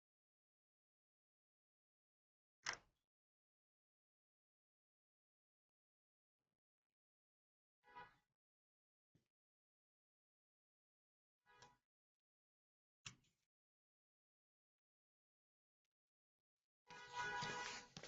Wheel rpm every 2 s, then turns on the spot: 0, 0, 0, 0, 0, 0, 0, 0, 0.
none